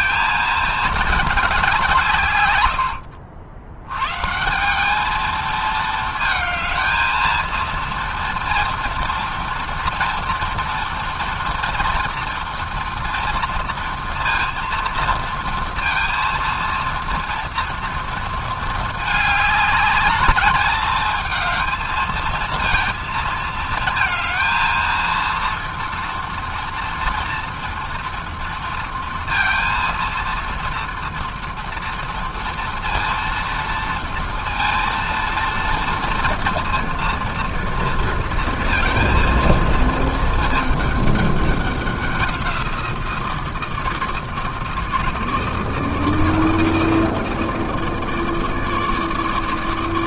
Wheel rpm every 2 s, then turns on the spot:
200, 70, 220, 230, 230, 230, 240, 230, 230, 210, 220, 220, 230, 230, 230, 230, 230, 230, 230, 230, 200, 160, 160, 160, 160.
none